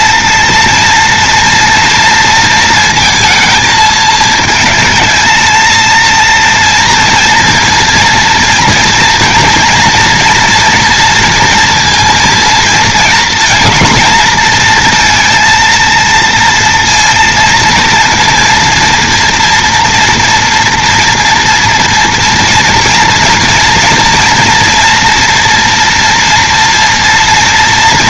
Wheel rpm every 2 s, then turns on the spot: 230, 230, 220, 230, 230, 240, 230, 230, 230, 230, 230, 240, 230, 240.
none